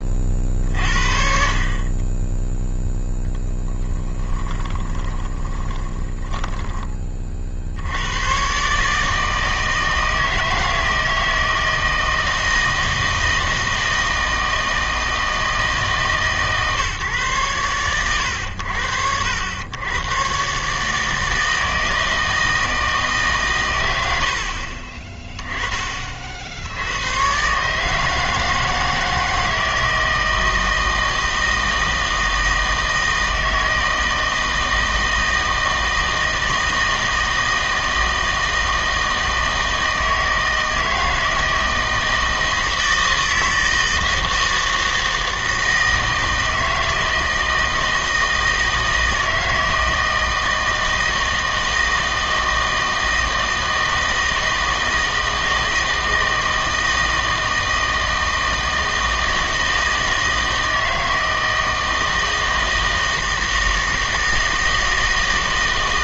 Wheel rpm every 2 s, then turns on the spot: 40, 0, 20, 10, 130, 160, 160, 160, 150, 90, 140, 160, 50, 80, 160, 160, 160, 160, 160, 160, 160, 160, 160, 160, 160, 160, 160, 160, 160, 160, 160, 160, 160.
4-8